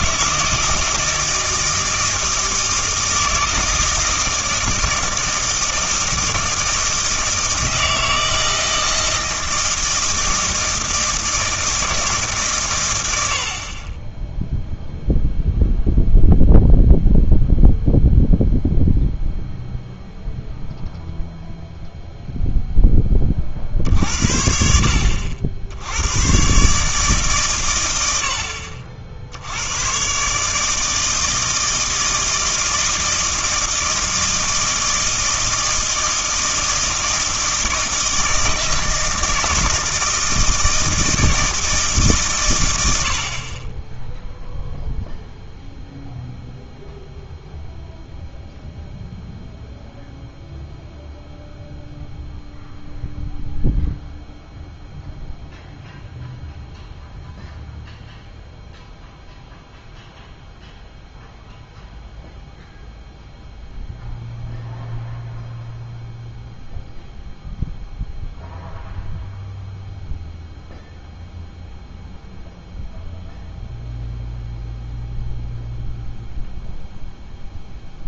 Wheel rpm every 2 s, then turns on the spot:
160, 160, 160, 160, 160, 160, 130, 0, 0, 0, 0, 0, 60, 140, 60, 150, 160, 160, 160, 160, 160, 110, 0, 0, 0, 0, 0, 0, 0, 0, 0, 0, 0, 0, 0, 0, 0, 0, 0.
none